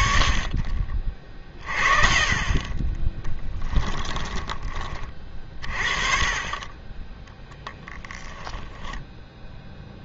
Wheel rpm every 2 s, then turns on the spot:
40, 20, 20, 20, 10.
8-10